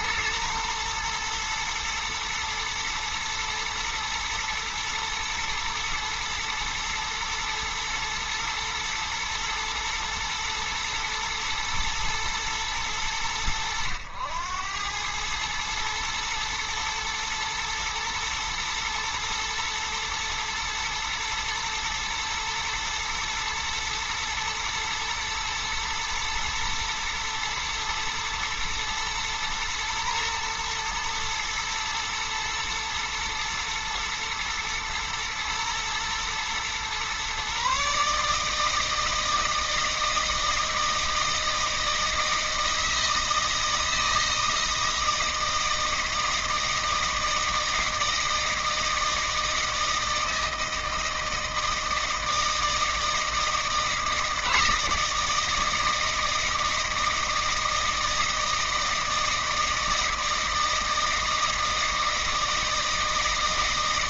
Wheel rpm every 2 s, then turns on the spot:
120, 120, 110, 110, 120, 120, 110, 90, 110, 110, 110, 110, 120, 120, 110, 120, 110, 110, 120, 160, 160, 160, 160, 160, 160, 160, 160, 160, 160, 160, 160, 160.
none